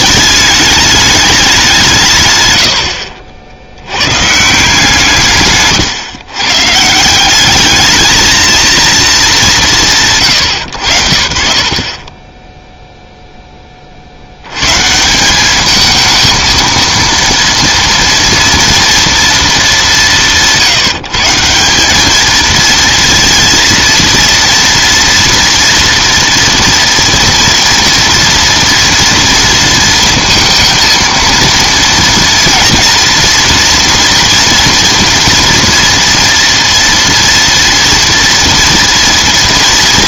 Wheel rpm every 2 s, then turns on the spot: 210, 100, 150, 130, 220, 80, 10, 120, 230, 230, 150, 230, 240, 230, 230, 230, 230, 230, 230, 230.
none